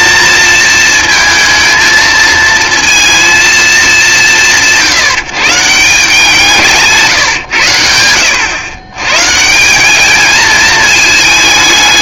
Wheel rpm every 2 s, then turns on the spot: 230, 230, 160, 160, 110, 220.
none